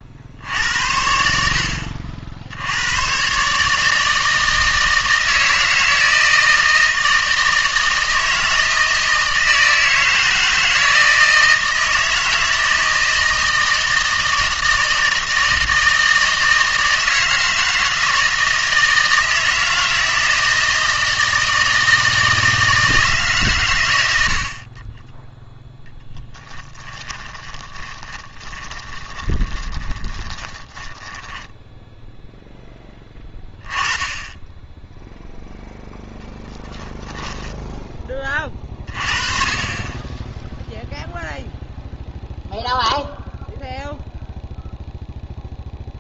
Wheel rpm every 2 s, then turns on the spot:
80, 80, 160, 160, 160, 170, 160, 160, 160, 160, 160, 160, 30, 10, 20, 10, 10, 10, 10, 30, 0, 0, 0.
26-32 36-38